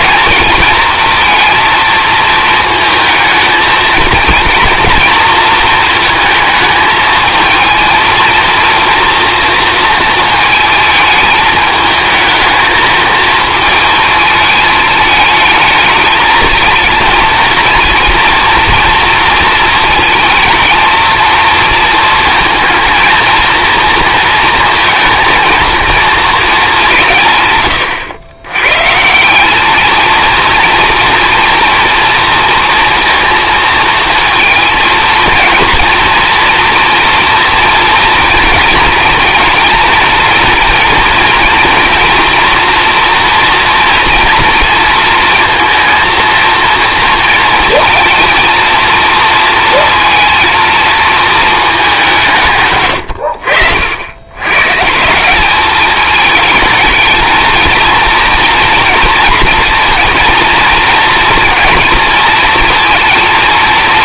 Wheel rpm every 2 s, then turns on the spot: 230, 230, 230, 230, 230, 220, 220, 220, 230, 230, 220, 230, 230, 100, 220, 230, 230, 240, 230, 230, 230, 240, 230, 230, 230, 190, 80, 210, 230, 230, 230, 230.
none